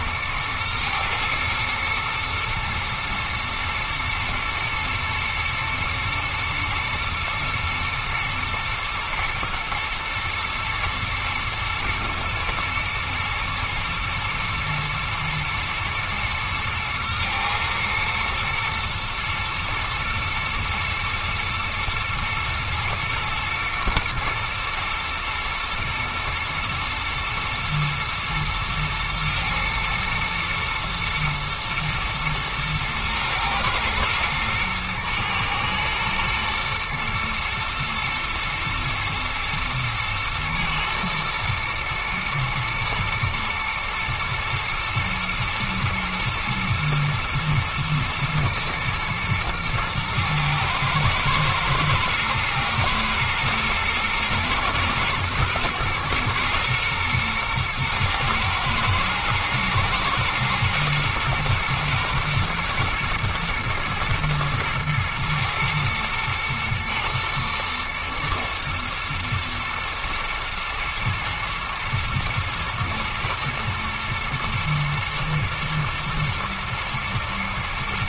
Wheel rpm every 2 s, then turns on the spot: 120, 110, 110, 110, 110, 110, 120, 120, 110, 120, 110, 120, 120, 120, 120, 120, 110, 110, 120, 110, 120, 120, 110, 120, 110, 110, 110, 120, 120, 110, 110, 110, 110, 120, 110, 110, 120, 120, 110.
none